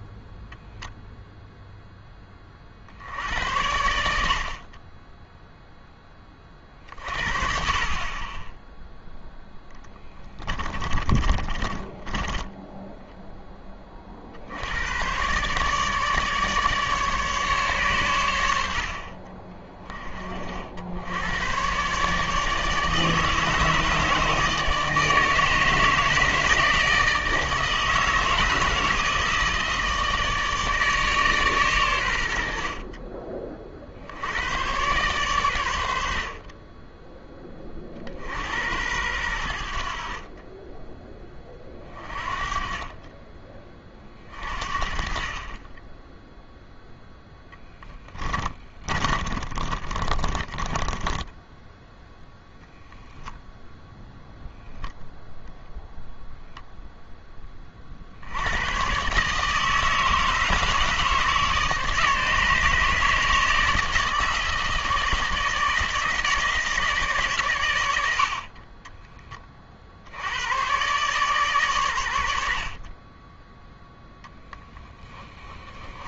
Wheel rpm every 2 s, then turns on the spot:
0, 50, 30, 40, 10, 20, 10, 90, 150, 70, 60, 150, 150, 160, 160, 150, 50, 120, 20, 90, 10, 30, 50, 0, 30, 20, 0, 0, 0, 110, 150, 150, 160, 160, 30, 130, 50, 20.
10-14 48-52 74-76